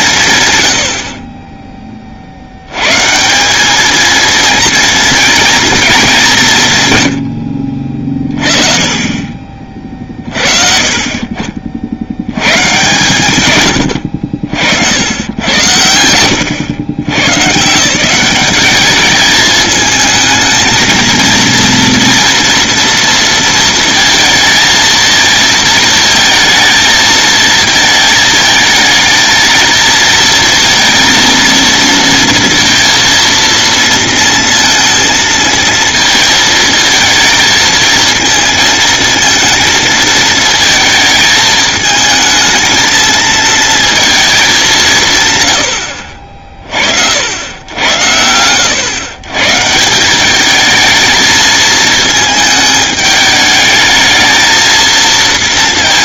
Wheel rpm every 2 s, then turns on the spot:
100, 120, 230, 140, 30, 40, 130, 80, 100, 200, 220, 230, 230, 230, 220, 230, 230, 230, 230, 230, 220, 220, 180, 60, 110, 220, 220, 230.
none